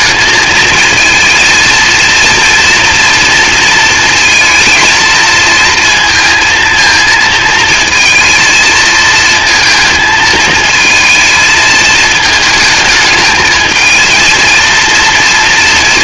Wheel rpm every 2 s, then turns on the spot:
220, 230, 230, 230, 230, 220, 220, 230.
none